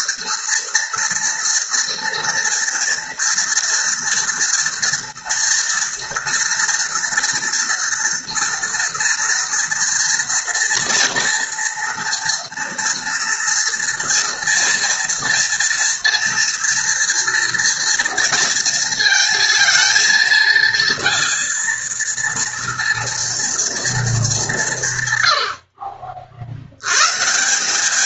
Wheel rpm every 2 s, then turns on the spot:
240, 230, 230, 240, 230, 230, 230, 230, 230, 230, 230, 230, 140, 100.
none